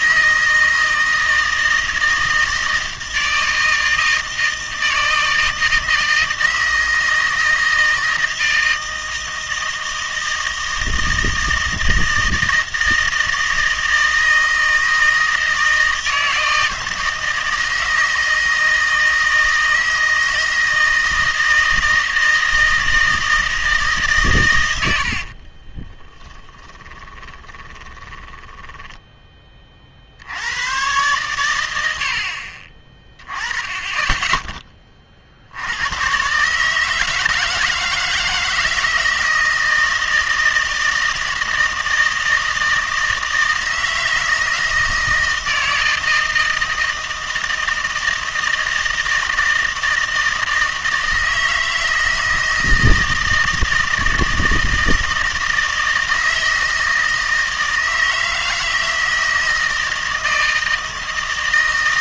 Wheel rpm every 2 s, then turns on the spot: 160, 160, 160, 160, 160, 160, 160, 160, 160, 160, 160, 160, 100, 10, 10, 100, 30, 20, 150, 160, 160, 160, 160, 160, 160, 160, 160, 160, 160, 160, 160.
26-30